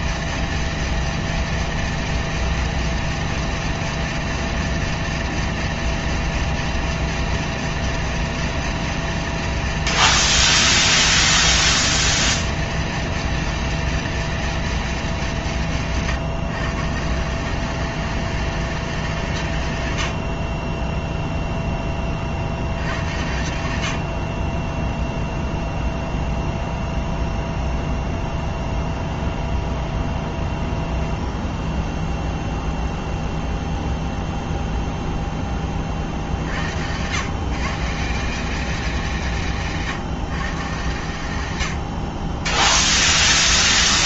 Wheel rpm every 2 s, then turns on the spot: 230, 230, 230, 230, 230, 230, 230, 230, 160, 210, 30, 70, 20, 0, 0, 0, 0, 0, 80, 200, 140, 10.
20-22